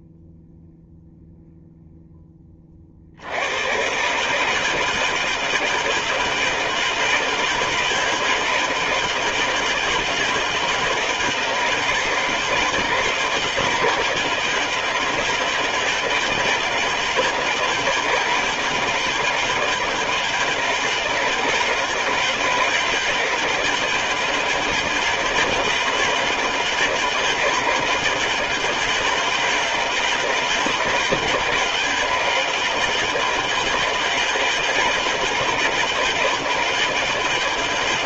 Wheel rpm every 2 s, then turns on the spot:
0, 40, 160, 160, 160, 160, 160, 160, 160, 160, 160, 160, 160, 160, 160, 160, 160, 160, 160.
none